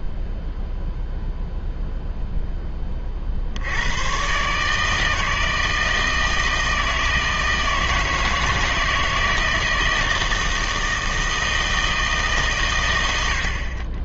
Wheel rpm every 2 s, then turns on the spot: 0, 20, 150, 160, 160, 160, 110.
none